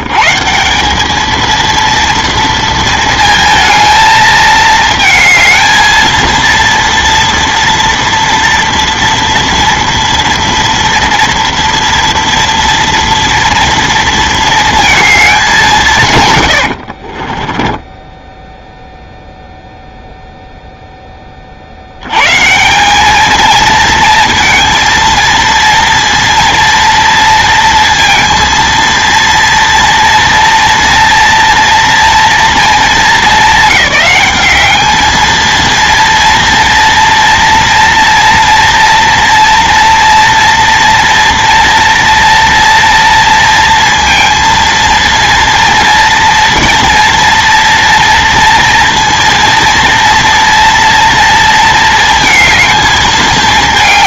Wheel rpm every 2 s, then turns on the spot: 120, 230, 220, 230, 240, 230, 230, 230, 90, 0, 0, 160, 230, 230, 230, 230, 230, 210, 230, 230, 240, 230, 230, 230, 230, 230, 220.
16-18